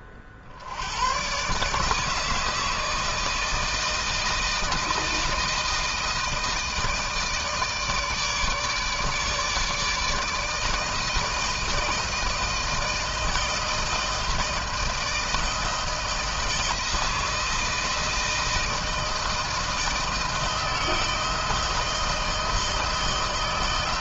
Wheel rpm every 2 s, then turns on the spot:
60, 160, 160, 160, 150, 160, 160, 160, 160, 160, 160, 160.
none